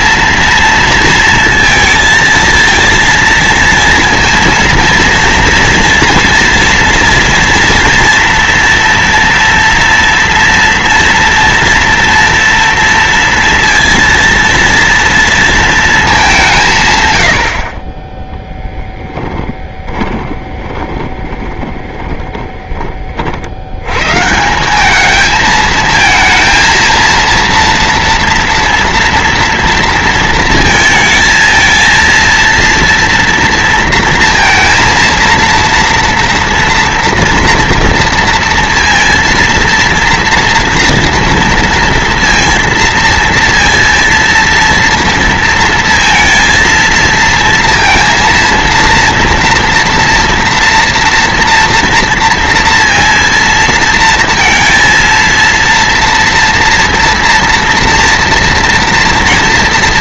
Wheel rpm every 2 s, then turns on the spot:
230, 230, 230, 230, 240, 230, 230, 230, 170, 10, 20, 20, 170, 230, 230, 230, 230, 230, 230, 230, 230, 230, 230, 230, 230, 230, 230, 230, 230, 230.
18-22